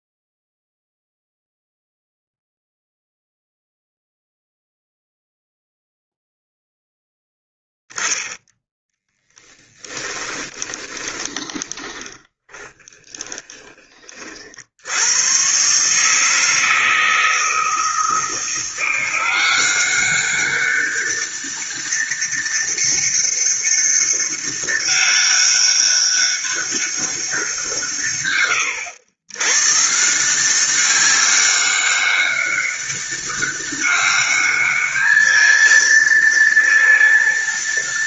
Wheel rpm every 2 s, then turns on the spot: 0, 0, 0, 0, 10, 20, 20, 40, 160, 160, 190, 200, 200, 200, 130, 170, 200, 200, 230.
10-14